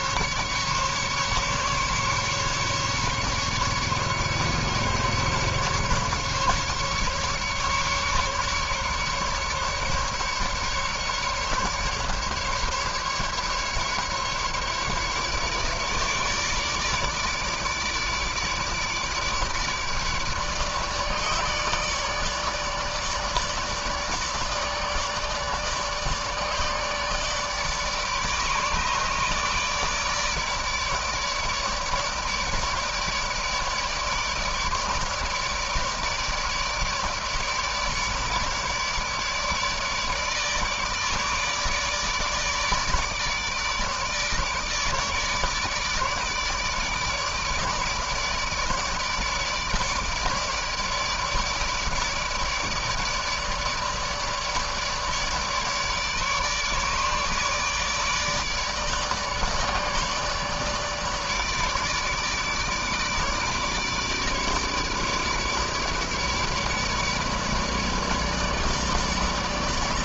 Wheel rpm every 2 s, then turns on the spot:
150, 140, 140, 140, 150, 150, 140, 150, 150, 150, 150, 150, 150, 150, 150, 150, 150, 150, 160, 150, 150, 150, 150, 150, 150, 150, 150, 150, 150, 150, 150, 150, 150, 150, 150.
none